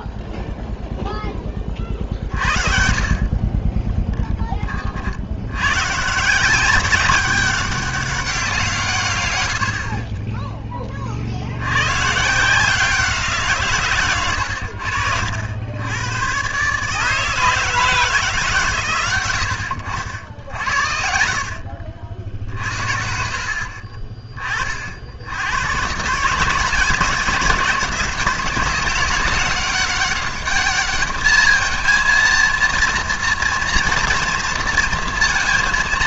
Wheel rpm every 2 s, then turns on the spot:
0, 50, 30, 190, 180, 20, 160, 80, 140, 140, 70, 60, 30, 160, 190, 210, 230, 230.
none